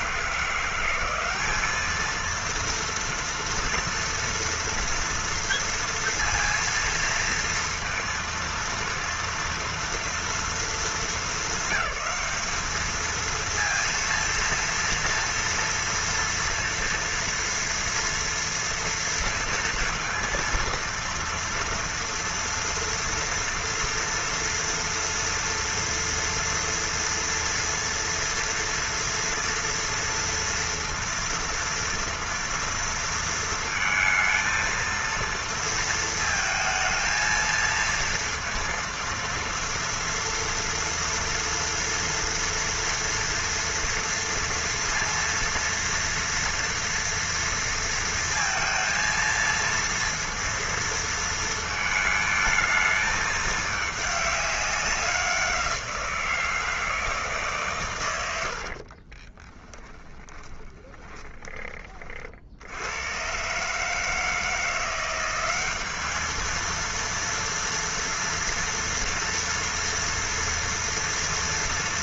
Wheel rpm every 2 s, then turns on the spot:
170, 230, 230, 230, 230, 230, 220, 230, 230, 230, 230, 230, 230, 240, 230, 230, 230, 220, 230, 230, 230, 230, 230, 230, 230, 230, 220, 210, 170, 90, 10, 50, 160, 220, 230, 230.
60-62